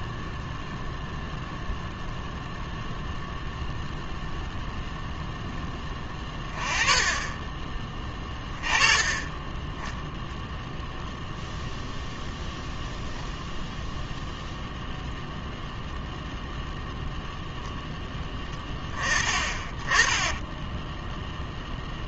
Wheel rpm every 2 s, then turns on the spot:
0, 0, 0, 10, 30, 0, 0, 0, 0, 20, 10.
none